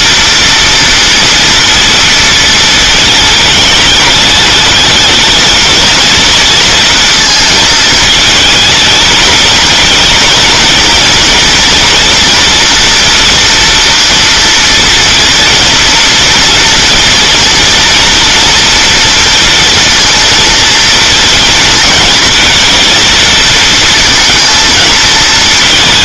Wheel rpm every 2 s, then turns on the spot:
230, 220, 220, 230, 220, 230, 230, 230, 230, 240, 230, 230, 230.
none